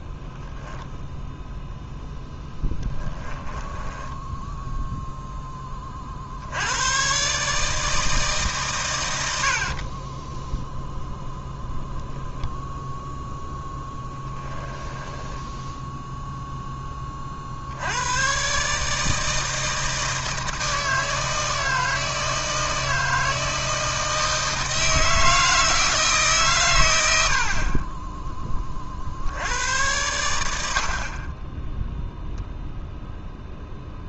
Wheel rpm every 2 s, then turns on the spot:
0, 10, 0, 110, 120, 0, 0, 10, 20, 150, 160, 160, 160, 100, 50, 60, 0.
2-4 14-16